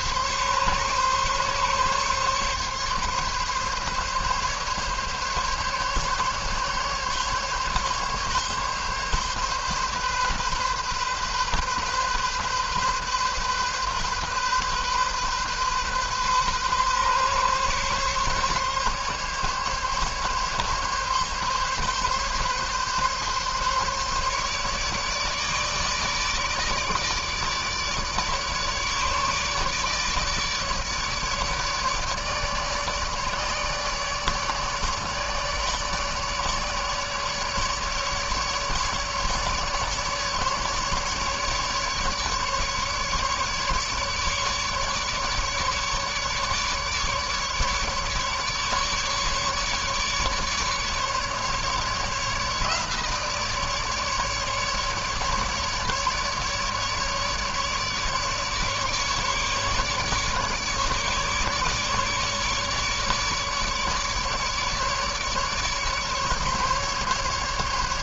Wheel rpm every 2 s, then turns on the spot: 140, 140, 140, 140, 140, 130, 130, 130, 130, 140, 140, 140, 150, 150, 150, 150, 150, 150, 150, 150, 150, 150, 150, 150, 150, 150, 150, 150, 150, 150, 150, 150, 150, 150.
none